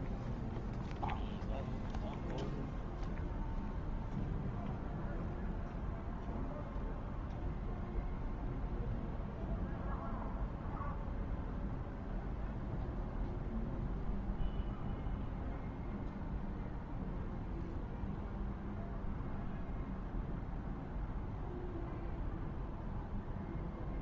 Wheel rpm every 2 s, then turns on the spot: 0, 0, 0, 0, 0, 0, 0, 0, 0, 0, 0, 0.
none